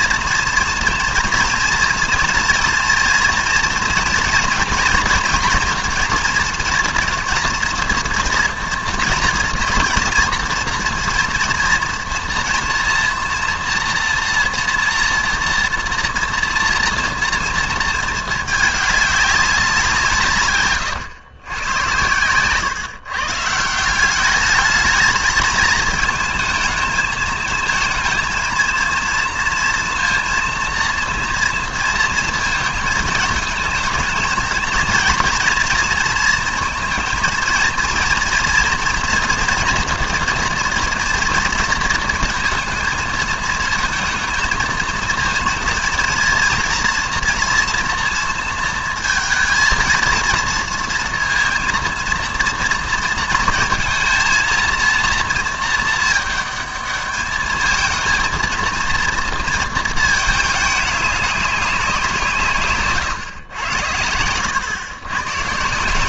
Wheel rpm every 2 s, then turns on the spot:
230, 230, 240, 230, 230, 230, 240, 240, 230, 210, 140, 130, 210, 220, 230, 230, 220, 230, 230, 240, 240, 220, 220, 230, 230, 230, 230, 230, 210, 230, 210, 150, 110.
none